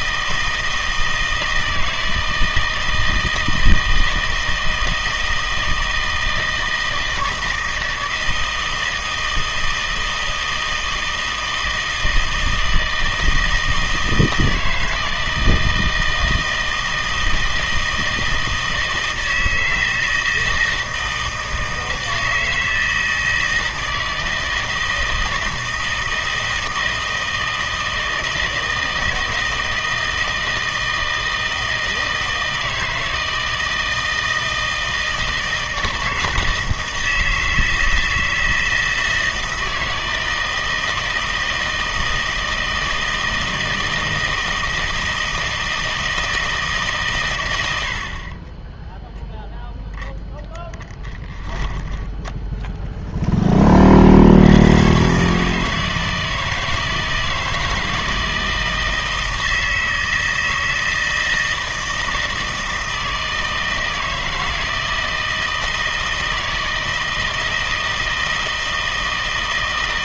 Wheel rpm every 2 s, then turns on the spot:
160, 160, 160, 160, 160, 160, 160, 160, 160, 160, 160, 160, 160, 160, 160, 160, 160, 160, 160, 160, 160, 160, 160, 160, 20, 10, 0, 100, 160, 160, 160, 160, 160, 160, 160.
48-50